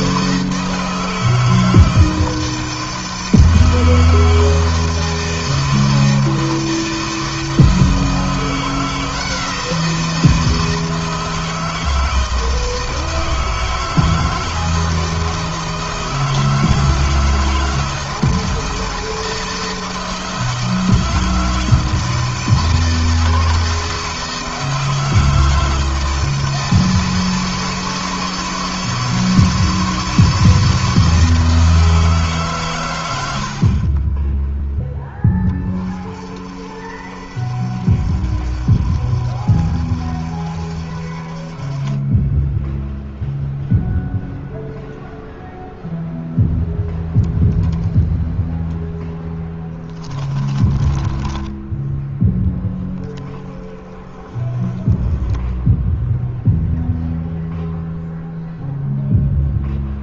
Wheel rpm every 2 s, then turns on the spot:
160, 160, 160, 160, 170, 160, 160, 160, 160, 160, 160, 160, 160, 160, 160, 160, 90, 10, 50, 50, 40, 0, 0, 0, 0, 10, 10, 10, 0, 0.
50-52